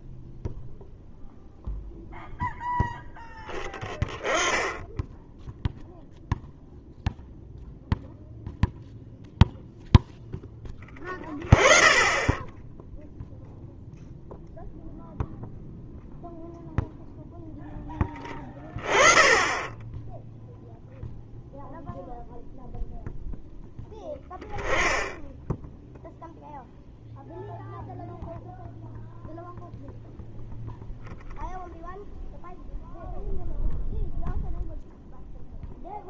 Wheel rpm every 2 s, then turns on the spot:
0, 0, 10, 0, 0, 10, 0, 0, 0, 30, 0, 0, 10, 0, 0, 0, 0, 0.
none